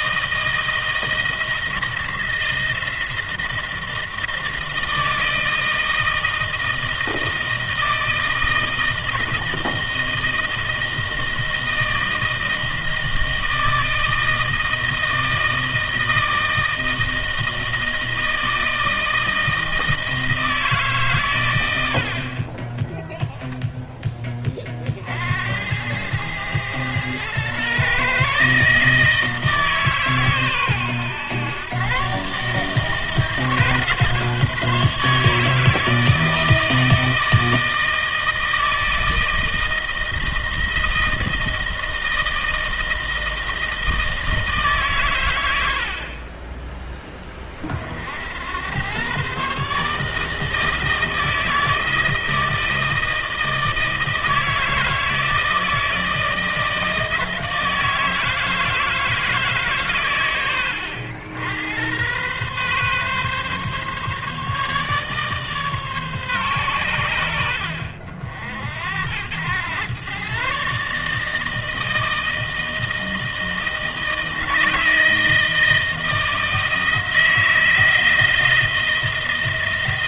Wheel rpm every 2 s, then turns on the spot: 160, 160, 160, 160, 160, 160, 160, 160, 160, 160, 150, 30, 30, 110, 150, 130, 140, 150, 160, 160, 160, 160, 150, 20, 90, 160, 160, 160, 160, 160, 100, 130, 150, 120, 70, 140, 160, 160, 160, 160.
none